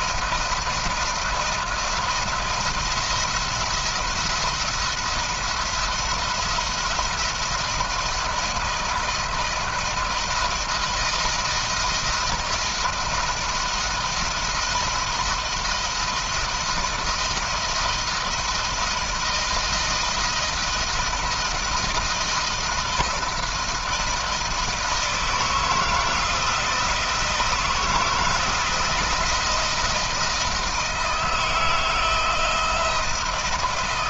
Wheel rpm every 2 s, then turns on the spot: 170, 170, 170, 170, 160, 170, 160, 160, 170, 160, 160, 170, 160, 160, 170, 160, 160.
none